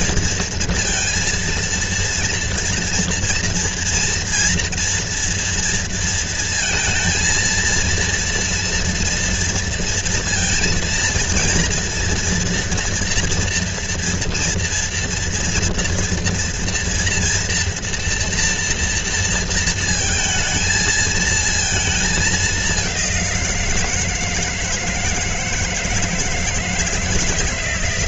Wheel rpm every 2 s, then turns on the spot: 230, 230, 230, 230, 230, 230, 240, 230, 230, 230, 220, 200, 160, 160.
none